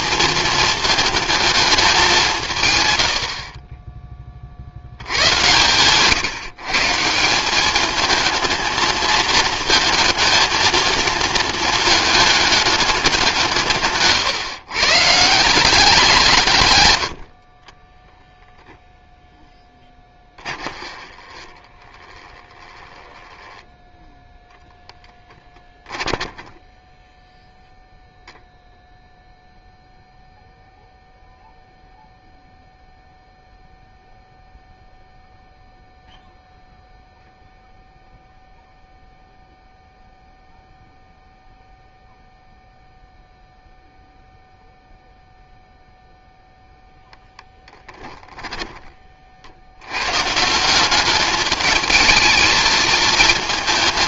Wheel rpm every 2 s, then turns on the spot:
220, 130, 60, 160, 220, 230, 210, 140, 130, 0, 20, 10, 0, 10, 0, 0, 0, 0, 0, 0, 0, 0, 0, 0, 20, 170, 220.
20-24 26-28